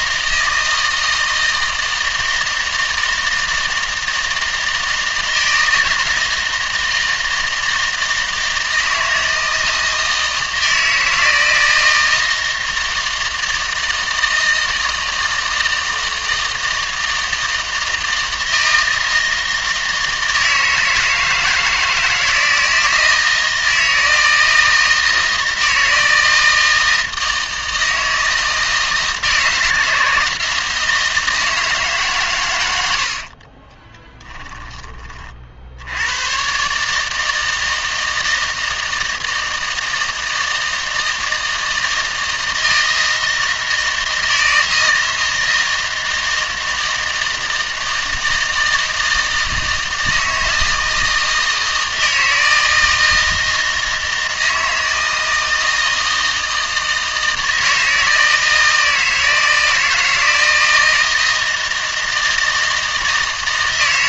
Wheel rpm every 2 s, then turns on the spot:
160, 160, 160, 160, 160, 160, 160, 160, 160, 160, 160, 160, 160, 160, 160, 160, 90, 20, 150, 160, 160, 160, 160, 160, 160, 160, 160, 160, 160, 160, 160, 160.
none